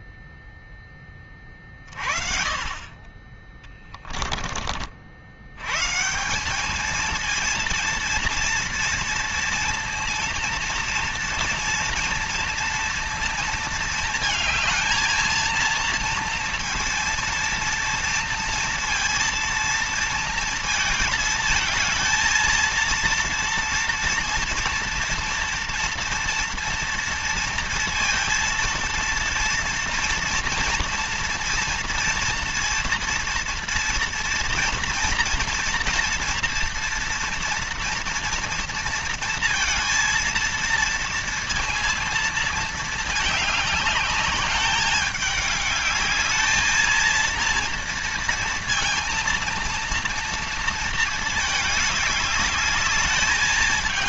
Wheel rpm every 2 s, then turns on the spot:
0, 40, 20, 180, 230, 230, 230, 220, 230, 230, 220, 230, 230, 230, 230, 230, 230, 230, 230, 230, 230, 220, 210, 220, 230, 230, 210.
none